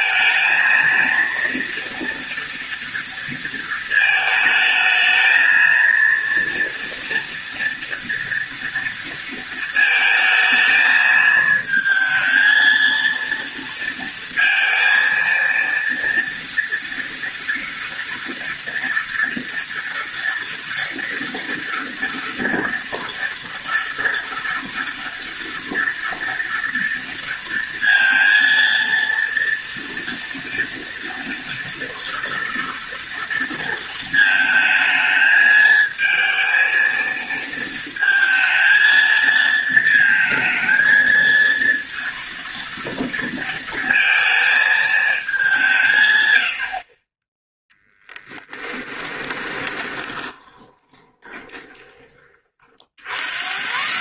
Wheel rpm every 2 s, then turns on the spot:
230, 230, 220, 230, 230, 220, 230, 230, 230, 230, 230, 230, 230, 230, 230, 230, 230, 220, 230, 220, 220, 230, 220, 40, 10, 20, 60.
48-52